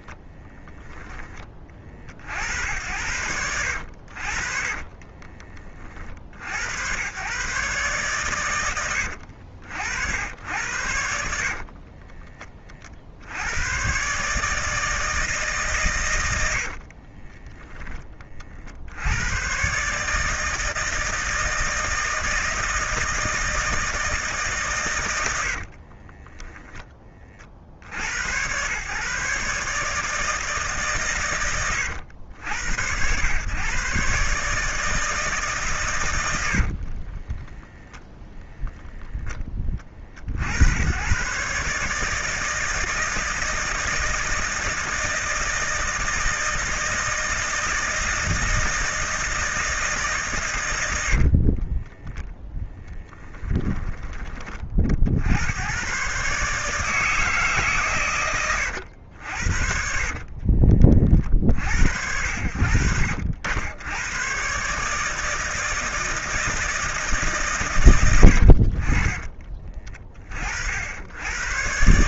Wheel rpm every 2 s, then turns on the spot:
0, 70, 40, 100, 100, 80, 40, 150, 60, 60, 160, 160, 140, 10, 110, 160, 100, 150, 60, 0, 80, 160, 160, 160, 160, 130, 10, 30, 140, 100, 30, 70, 130, 160, 60, 50.
4-6 16-18 36-38 52-54 60-62